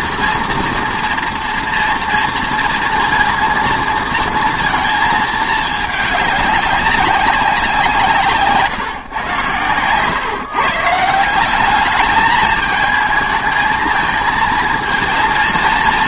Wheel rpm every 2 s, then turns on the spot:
240, 230, 230, 200, 150, 150, 220, 230.
none